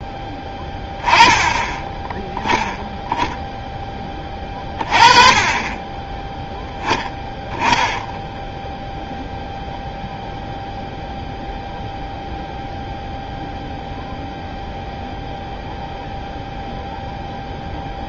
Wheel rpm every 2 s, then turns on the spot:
10, 10, 30, 10, 0, 0, 0, 0, 0.
none